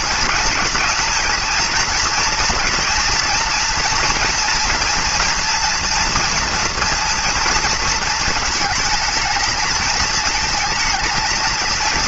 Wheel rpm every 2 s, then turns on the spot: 220, 230, 230, 230, 220, 220.
none